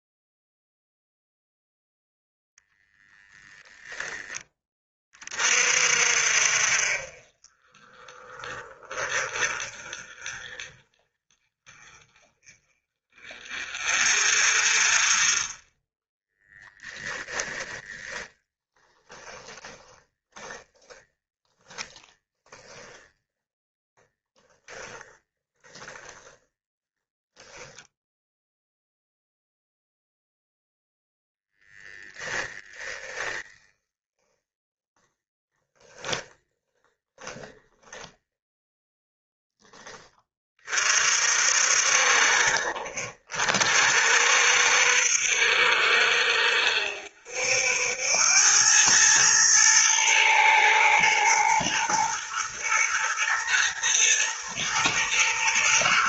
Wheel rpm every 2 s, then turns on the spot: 0, 0, 20, 50, 30, 30, 30, 40, 10, 10, 10, 0, 20, 10, 0, 0, 10, 10, 20, 10, 40, 50, 60, 60, 100, 110, 120, 110.
16-20 24-28 32-34 36-40